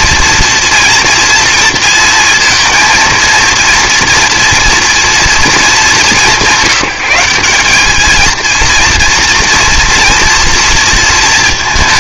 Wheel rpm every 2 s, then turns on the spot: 230, 230, 230, 180, 230, 230.
none